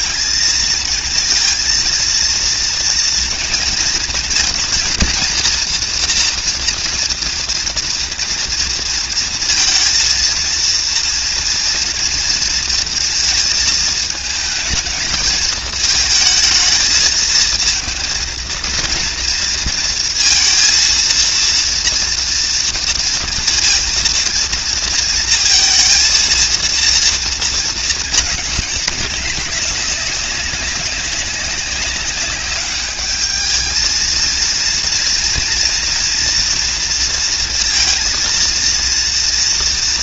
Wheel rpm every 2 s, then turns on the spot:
230, 230, 230, 230, 230, 230, 230, 220, 220, 230, 230, 230, 230, 230, 200, 200, 210, 230, 230, 230.
none